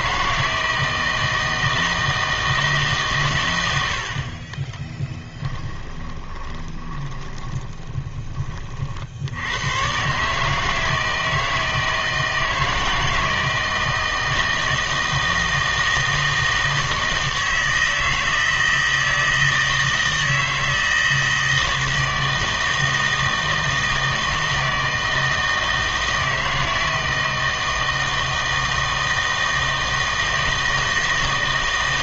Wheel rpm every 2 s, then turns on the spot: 160, 150, 30, 20, 40, 160, 160, 160, 160, 160, 160, 160, 160, 160, 160, 160.
4-8